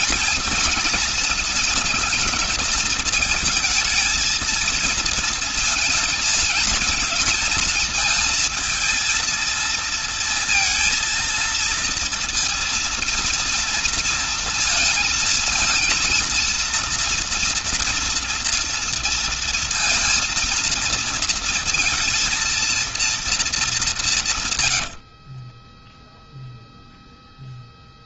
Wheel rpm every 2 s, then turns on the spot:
230, 210, 220, 230, 230, 230, 230, 230, 230, 230, 230, 230, 130, 0.
24-26